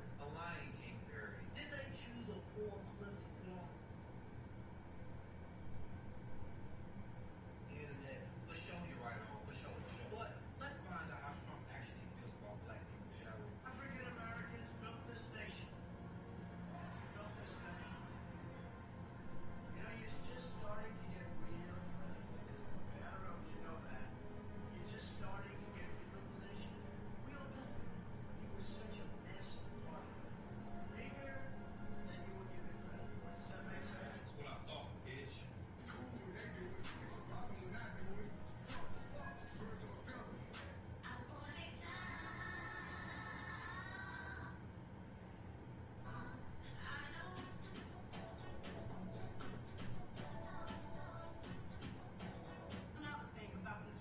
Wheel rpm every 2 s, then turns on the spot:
0, 0, 0, 0, 0, 0, 0, 0, 0, 0, 0, 0, 0, 0, 0, 0, 0, 0, 0, 0, 0, 0, 0, 0, 0, 0, 0.
none